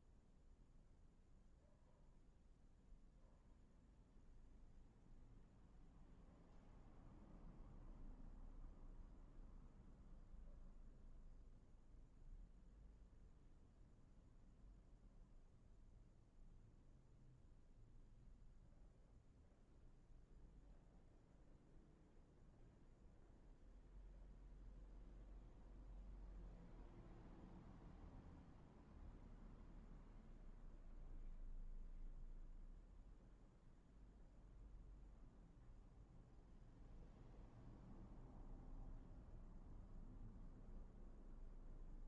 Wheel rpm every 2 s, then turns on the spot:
0, 0, 0, 0, 0, 0, 0, 0, 0, 0, 0, 0, 0, 0, 0, 0, 0, 0, 0, 0, 0.
none